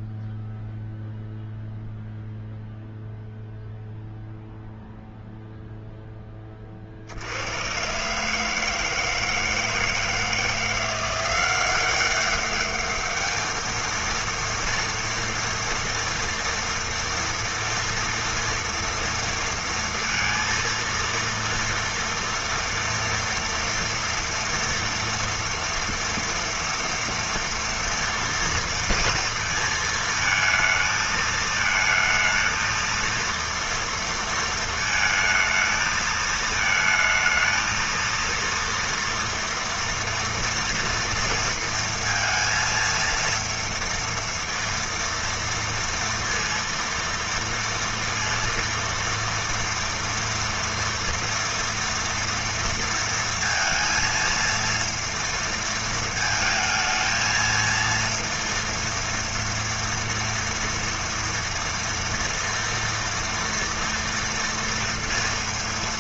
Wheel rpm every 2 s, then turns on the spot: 0, 0, 0, 10, 150, 160, 190, 230, 230, 230, 230, 230, 230, 230, 230, 230, 220, 230, 220, 230, 230, 230, 230, 230, 230, 230, 230, 230, 220, 230, 230, 230, 230.
none